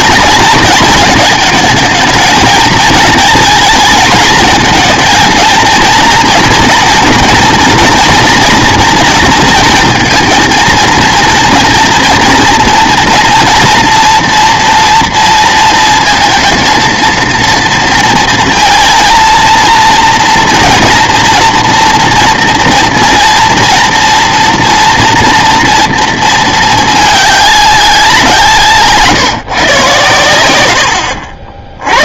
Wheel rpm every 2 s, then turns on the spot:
230, 220, 220, 230, 230, 230, 230, 240, 230, 230, 230, 230, 230, 220, 150, 90.
28-30